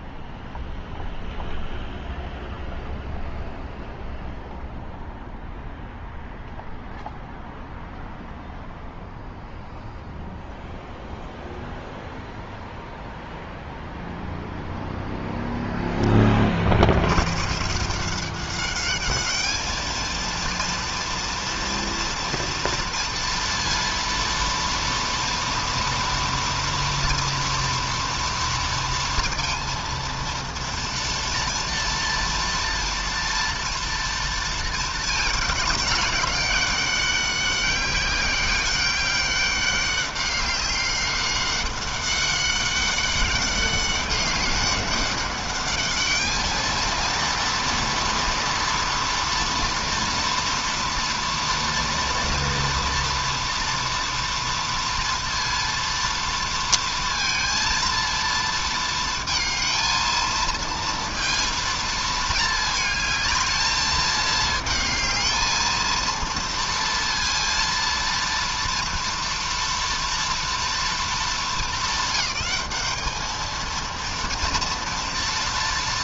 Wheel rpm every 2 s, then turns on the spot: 0, 0, 0, 0, 0, 0, 0, 0, 120, 210, 230, 230, 230, 230, 230, 230, 240, 220, 200, 200, 200, 200, 200, 230, 230, 230, 230, 230, 230, 230, 230, 220, 220, 230, 230, 220, 210, 230.
none